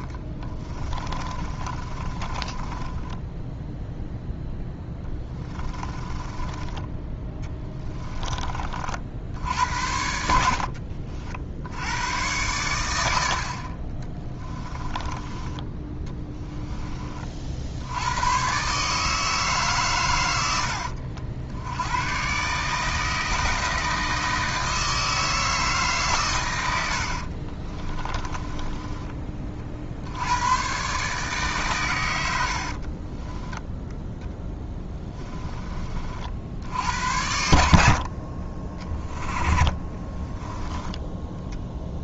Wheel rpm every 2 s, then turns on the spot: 20, 20, 10, 20, 40, 60, 100, 20, 20, 140, 70, 150, 160, 90, 20, 120, 60, 10, 80, 20, 10.
0-4 6-8 10-12 28-30 32-36